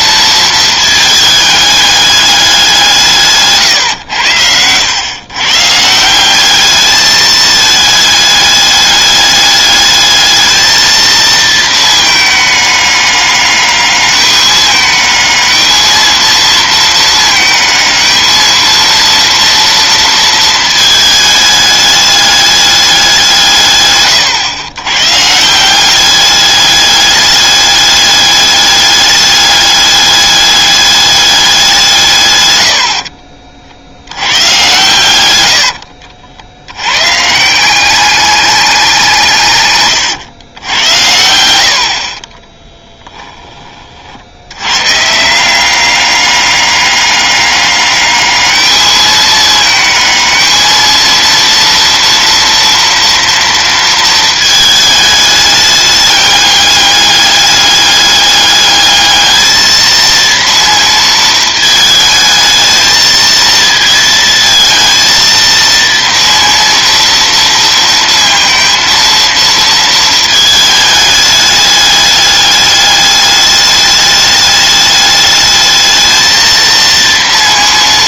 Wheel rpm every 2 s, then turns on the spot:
220, 190, 90, 200, 210, 220, 210, 210, 220, 220, 220, 210, 120, 200, 210, 210, 90, 110, 90, 200, 90, 10, 100, 200, 210, 220, 230, 220, 200, 210, 230, 220, 230, 230, 230, 220, 210, 210, 230.
32-34 42-44